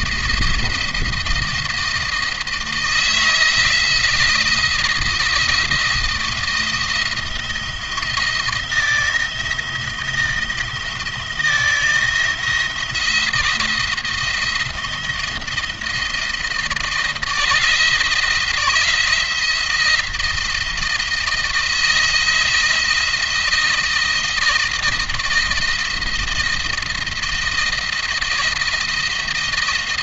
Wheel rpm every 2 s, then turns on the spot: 170, 160, 160, 170, 160, 170, 170, 170, 170, 170, 170, 170, 160, 170, 170.
none